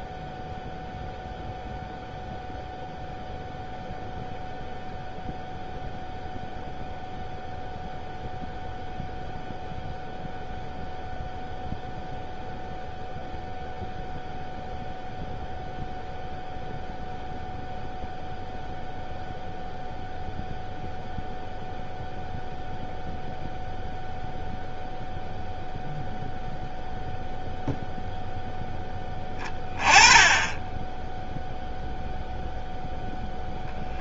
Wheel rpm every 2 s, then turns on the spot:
0, 0, 0, 0, 0, 0, 0, 0, 0, 0, 0, 0, 0, 0, 0, 10, 0.
none